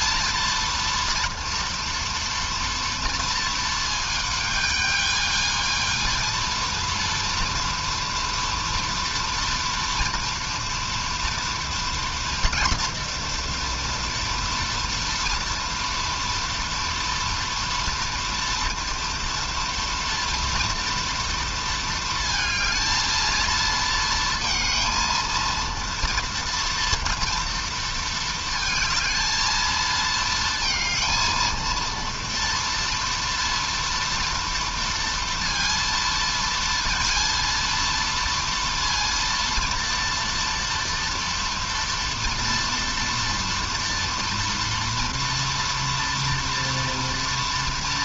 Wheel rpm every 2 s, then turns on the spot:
230, 230, 220, 230, 230, 230, 230, 230, 230, 230, 230, 220, 230, 230, 220, 230, 230, 230, 230, 230, 230, 240, 230, 230.
none